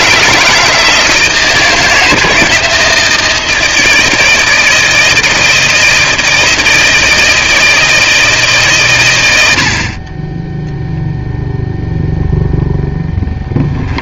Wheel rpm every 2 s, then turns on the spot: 160, 160, 160, 160, 100, 0, 0.
none